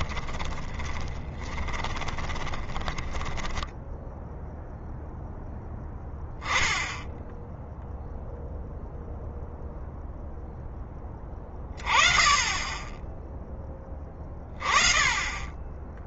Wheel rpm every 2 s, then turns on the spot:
20, 10, 0, 10, 0, 10, 10, 30.
0-4